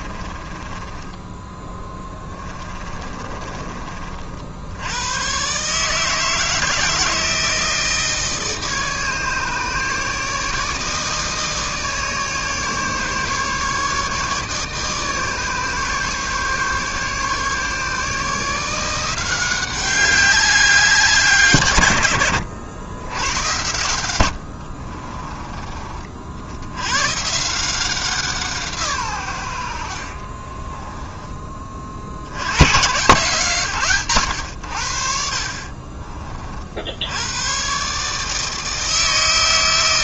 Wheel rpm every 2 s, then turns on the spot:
20, 20, 70, 160, 160, 150, 150, 150, 150, 160, 190, 100, 70, 80, 160, 20, 110, 80, 60, 160.
0-4 24-26 30-32